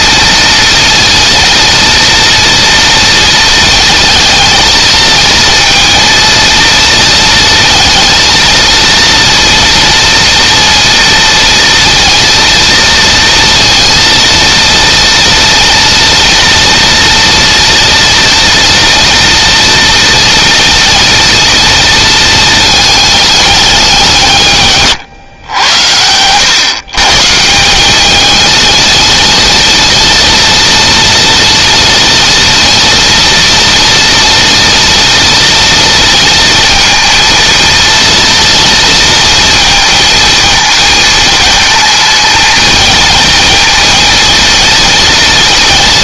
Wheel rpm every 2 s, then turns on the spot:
230, 230, 230, 230, 230, 230, 230, 230, 230, 230, 230, 220, 140, 130, 220, 230, 230, 230, 230, 230, 220, 230, 230.
none